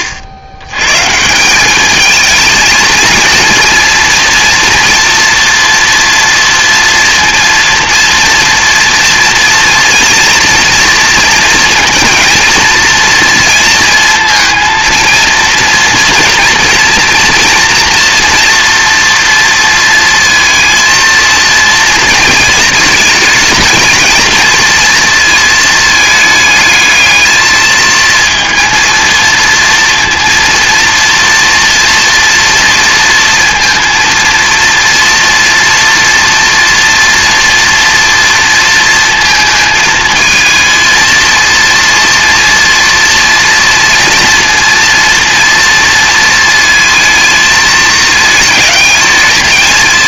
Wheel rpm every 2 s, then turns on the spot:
100, 220, 230, 230, 230, 230, 230, 230, 230, 230, 230, 220, 220, 210, 230, 230, 230, 230, 230, 230, 230, 230, 230, 230, 220.
none